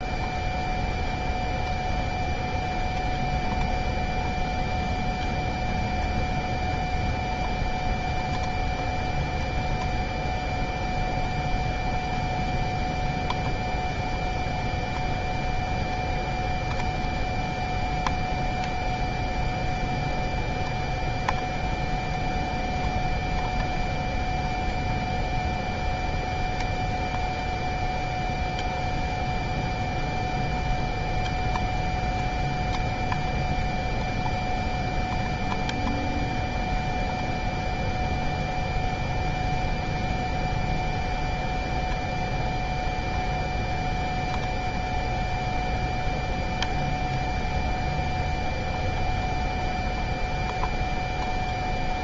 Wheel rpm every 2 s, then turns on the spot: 0, 0, 0, 0, 0, 0, 0, 0, 0, 0, 0, 0, 0, 0, 0, 0, 0, 0, 0, 0, 0, 0, 0, 0, 0, 0.
none